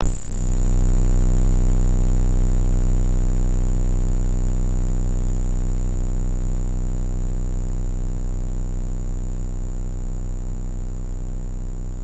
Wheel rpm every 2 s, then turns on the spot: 0, 0, 0, 0, 0, 0.
none